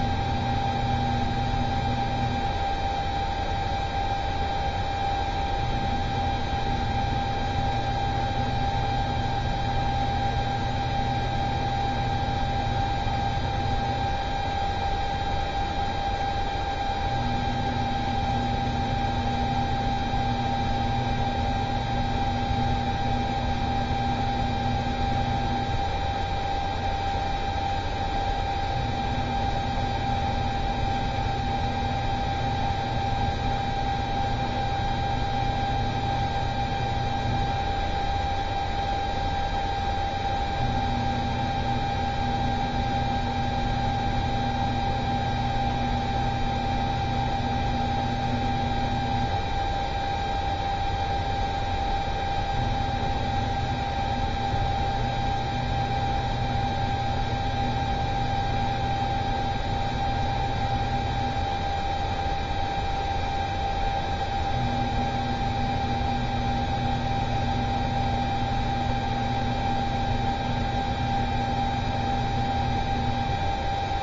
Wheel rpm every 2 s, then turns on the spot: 0, 0, 0, 0, 0, 0, 0, 0, 0, 0, 0, 0, 0, 0, 0, 0, 0, 0, 0, 0, 0, 0, 0, 0, 0, 0, 0, 0, 0, 0, 0, 0, 0, 0, 0, 0, 0.
none